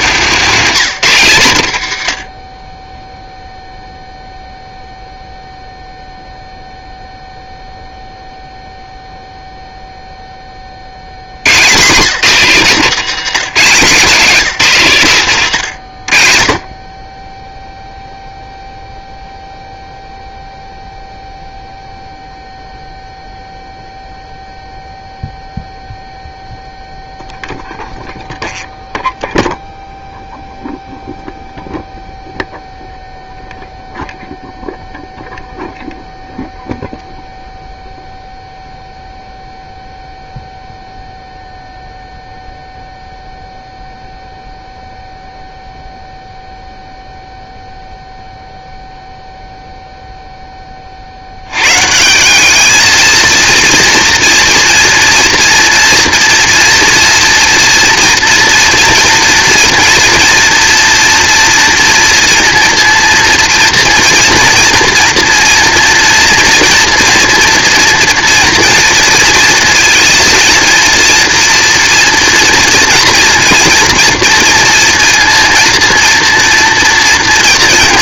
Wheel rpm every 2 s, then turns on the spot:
190, 40, 0, 0, 0, 30, 180, 170, 40, 0, 0, 0, 0, 0, 0, 0, 0, 0, 0, 0, 0, 0, 0, 0, 0, 10, 200, 230, 230, 230, 230, 230, 230, 230, 230, 230, 230, 230, 230.
none